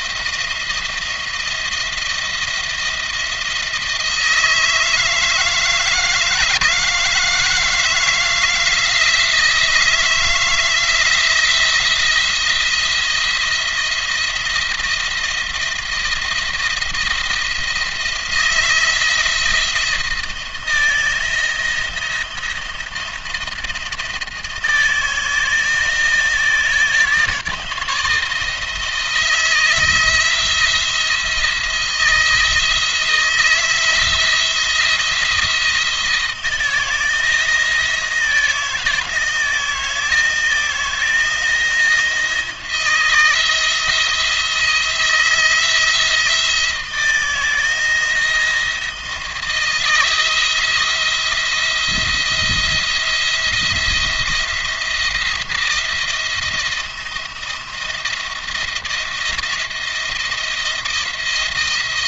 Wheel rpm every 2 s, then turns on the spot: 170, 170, 160, 160, 160, 160, 170, 170, 170, 170, 160, 170, 160, 160, 160, 170, 160, 170, 160, 160, 160, 160, 170, 170, 160, 170, 170, 170, 170, 170, 170.
none